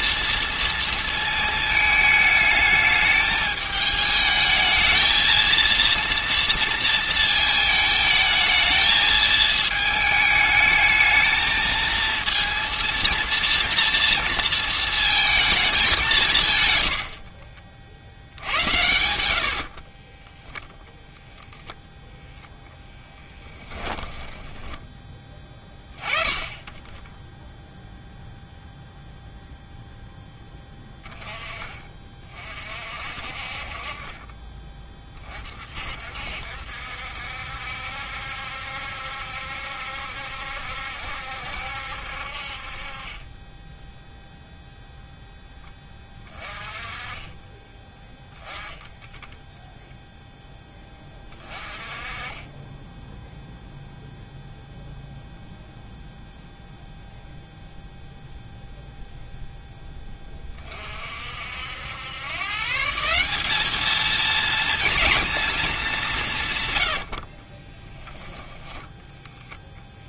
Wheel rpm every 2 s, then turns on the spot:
230, 210, 220, 230, 220, 220, 230, 230, 100, 90, 0, 10, 20, 20, 0, 10, 50, 30, 60, 70, 70, 40, 0, 20, 10, 10, 10, 0, 0, 0, 40, 170, 230, 120, 10.
none